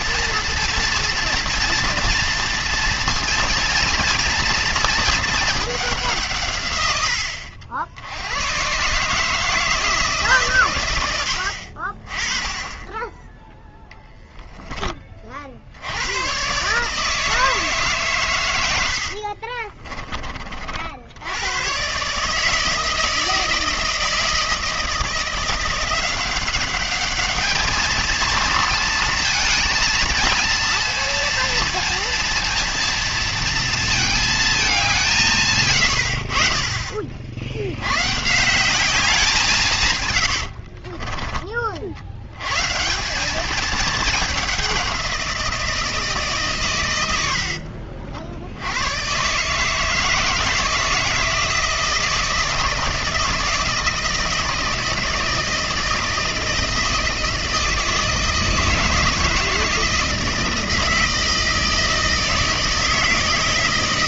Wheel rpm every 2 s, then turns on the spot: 230, 230, 110, 130, 120, 20, 10, 130, 110, 40, 160, 160, 190, 220, 230, 230, 220, 60, 140, 100, 90, 210, 150, 60, 160, 160, 160, 160, 160, 160, 160, 160.
38-40